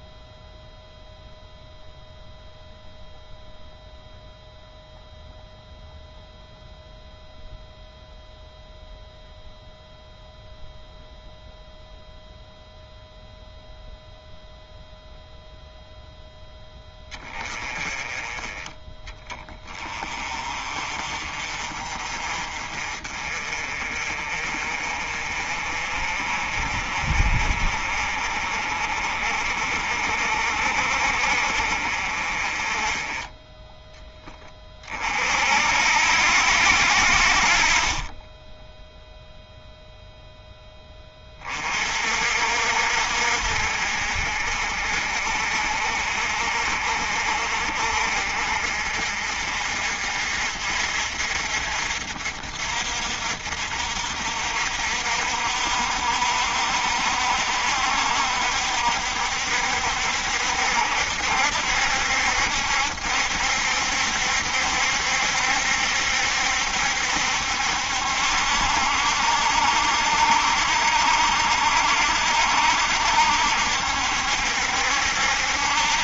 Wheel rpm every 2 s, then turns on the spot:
0, 0, 0, 0, 0, 0, 0, 0, 10, 20, 30, 40, 40, 40, 40, 40, 20, 30, 70, 0, 10, 60, 50, 50, 50, 50, 60, 60, 60, 60, 70, 70, 70, 70, 70, 70, 70, 70.
none